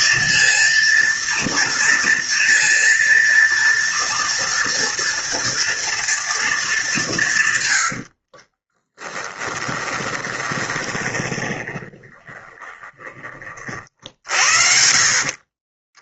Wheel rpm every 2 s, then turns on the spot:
230, 230, 230, 210, 20, 20, 20, 50.
8-16